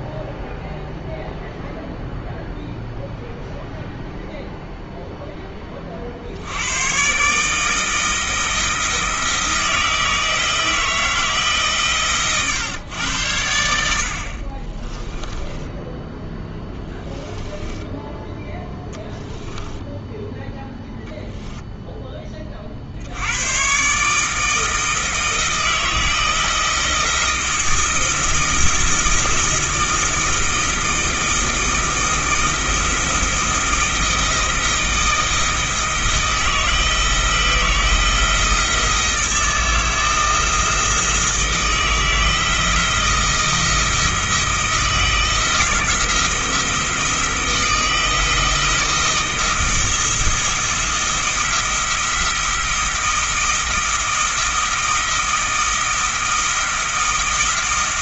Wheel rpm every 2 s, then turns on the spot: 0, 0, 0, 110, 160, 160, 110, 20, 10, 10, 0, 50, 160, 160, 170, 160, 170, 160, 160, 160, 160, 170, 160, 170, 170, 160, 170, 160, 160.
14-18